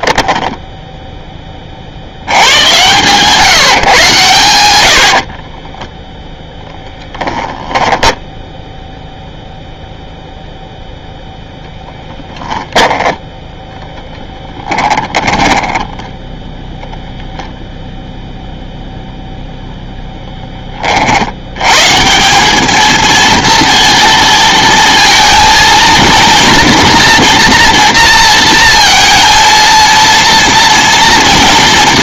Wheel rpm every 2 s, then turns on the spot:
0, 120, 90, 20, 0, 0, 10, 20, 0, 0, 30, 220, 230, 240, 230, 230.
6-8 14-16